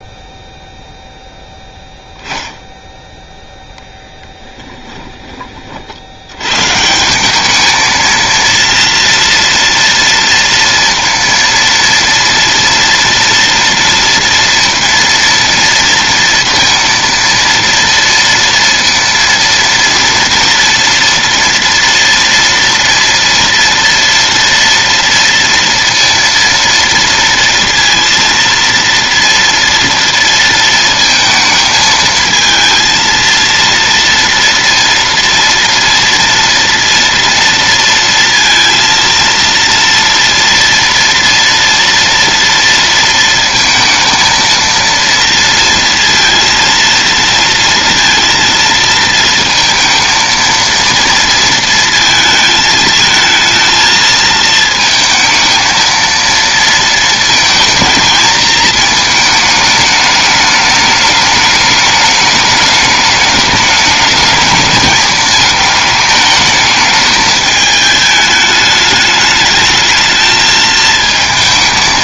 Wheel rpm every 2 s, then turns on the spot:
0, 10, 10, 130, 230, 230, 230, 230, 230, 230, 230, 230, 230, 230, 230, 230, 230, 230, 230, 230, 230, 230, 230, 230, 230, 230, 220, 220, 230, 220, 210, 210, 210, 220, 210, 220.
4-6